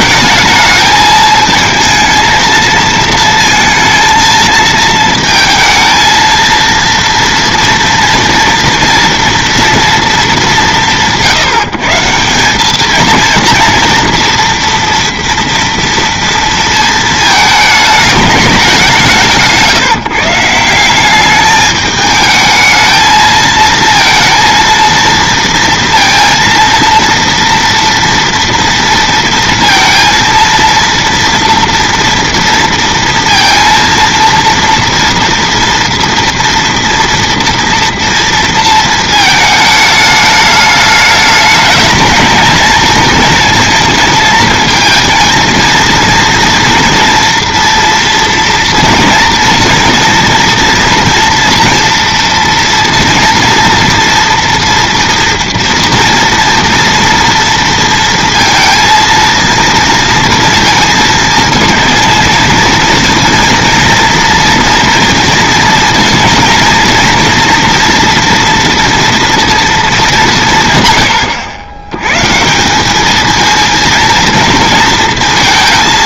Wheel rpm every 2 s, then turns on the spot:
220, 230, 230, 230, 230, 180, 210, 230, 230, 190, 170, 220, 230, 230, 230, 230, 230, 230, 230, 230, 210, 230, 230, 230, 230, 230, 230, 240, 230, 230, 230, 230, 230, 230, 230, 130, 190, 230.
none